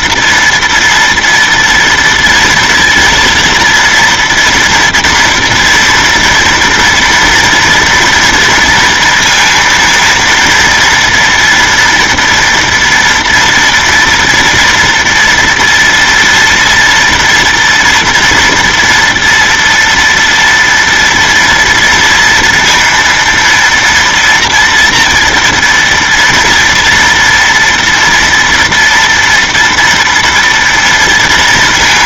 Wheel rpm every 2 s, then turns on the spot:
240, 230, 230, 230, 230, 230, 230, 230, 230, 230, 230, 230, 230, 230, 240, 230.
none